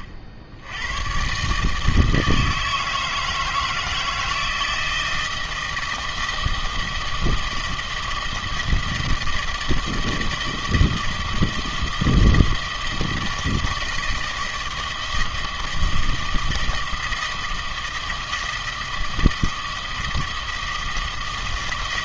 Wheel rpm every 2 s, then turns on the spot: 80, 160, 160, 160, 160, 160, 160, 160, 160, 160, 160.
none